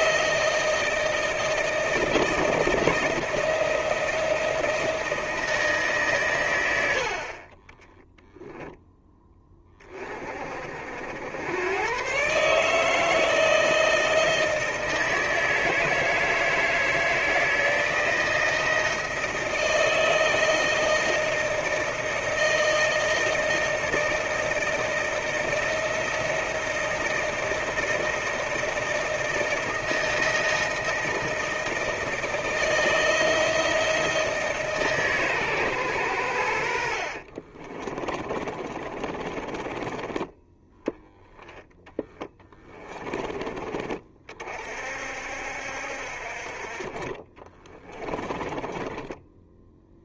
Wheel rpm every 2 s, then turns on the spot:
160, 160, 170, 130, 10, 40, 140, 160, 160, 160, 160, 160, 160, 160, 160, 160, 160, 160, 90, 30, 10, 10, 40, 50, 20.
38-40 42-44 48-50